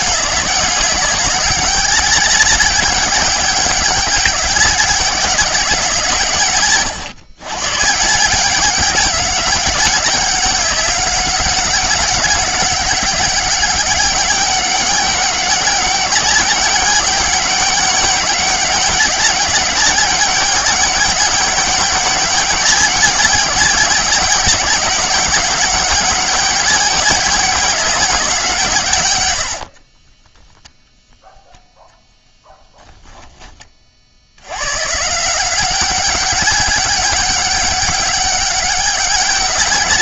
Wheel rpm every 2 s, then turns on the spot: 190, 200, 190, 140, 200, 190, 200, 190, 190, 190, 200, 200, 200, 200, 150, 0, 10, 130, 200, 200.
32-34